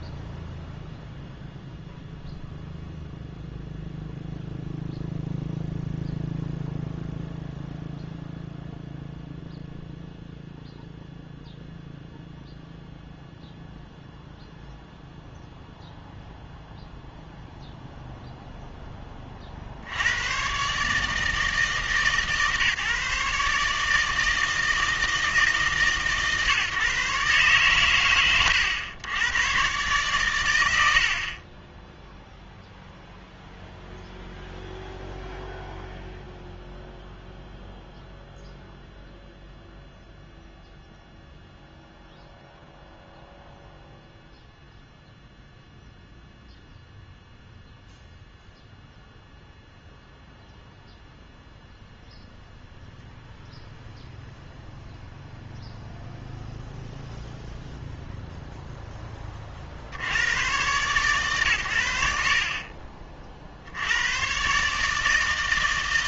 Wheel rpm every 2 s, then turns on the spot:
0, 0, 0, 0, 0, 0, 0, 0, 0, 10, 140, 150, 160, 140, 100, 70, 0, 0, 0, 0, 0, 0, 0, 0, 0, 0, 0, 0, 0, 0, 130, 40, 150.
none